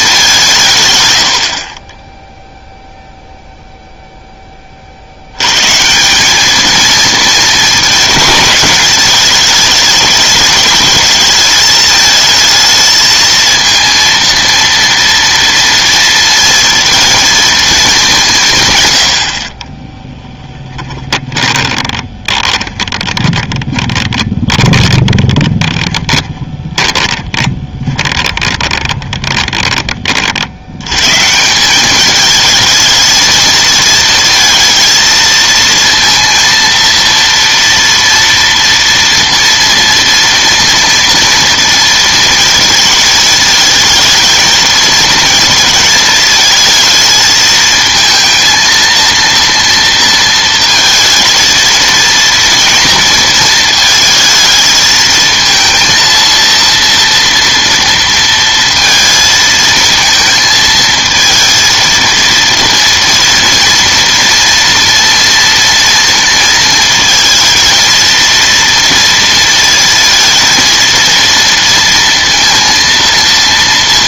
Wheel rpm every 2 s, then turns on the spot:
140, 0, 30, 210, 220, 210, 220, 230, 230, 130, 10, 20, 20, 10, 20, 90, 220, 230, 230, 230, 230, 230, 220, 220, 230, 230, 230, 220, 230, 230, 220, 230, 230, 230, 230, 230, 230.
20-30